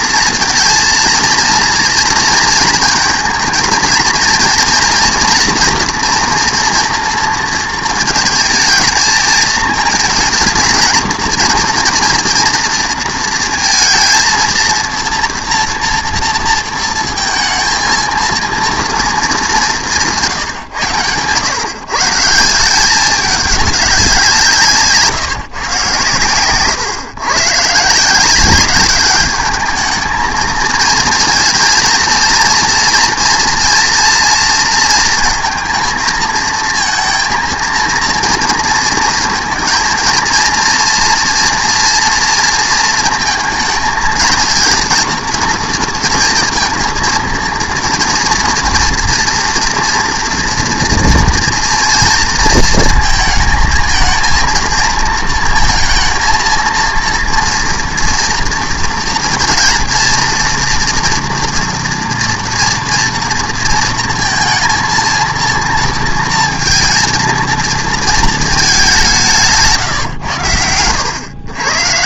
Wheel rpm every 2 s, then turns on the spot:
230, 220, 230, 230, 220, 230, 230, 230, 230, 230, 140, 180, 160, 130, 200, 220, 230, 230, 230, 230, 230, 230, 230, 230, 230, 230, 230, 230, 230, 230, 230, 230, 230, 230, 210, 100.
none